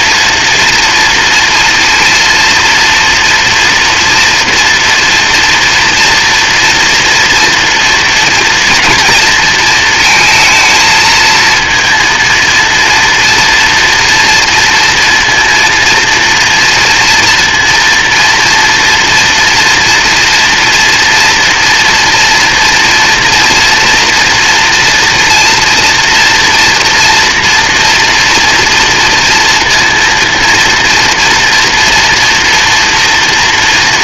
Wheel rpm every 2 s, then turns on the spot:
230, 230, 230, 240, 230, 220, 230, 230, 230, 230, 230, 230, 230, 240, 230, 230, 240.
none